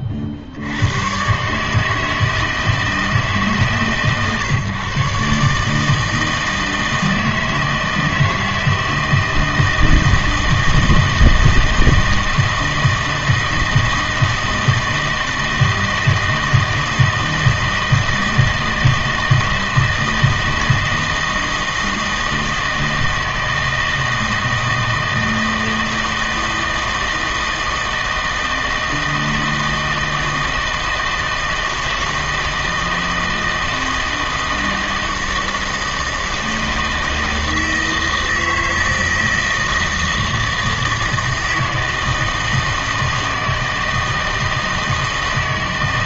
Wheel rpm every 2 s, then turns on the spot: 80, 160, 140, 160, 160, 160, 160, 160, 160, 160, 160, 160, 160, 170, 160, 160, 160, 160, 160, 160, 160, 160, 160.
none